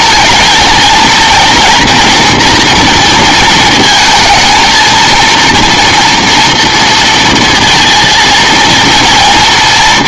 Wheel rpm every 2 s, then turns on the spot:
220, 230, 220, 230, 230.
none